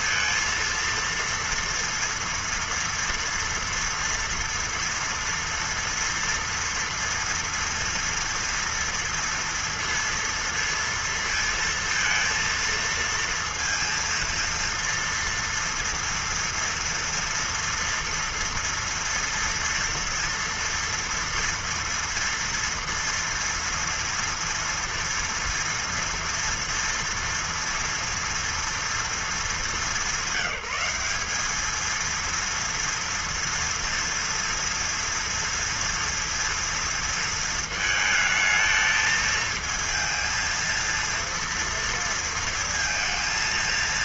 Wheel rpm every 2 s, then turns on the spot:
230, 230, 230, 230, 230, 230, 230, 230, 230, 230, 230, 230, 240, 230, 230, 200, 230, 230, 230, 220, 230, 230.
none